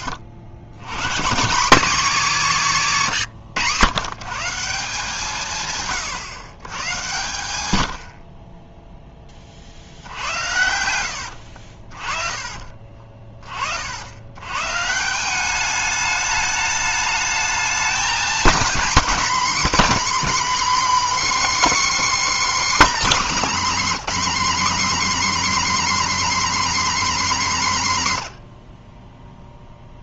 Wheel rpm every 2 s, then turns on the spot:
100, 180, 170, 120, 10, 80, 40, 150, 210, 240, 280, 270, 270, 270, 40.
2-4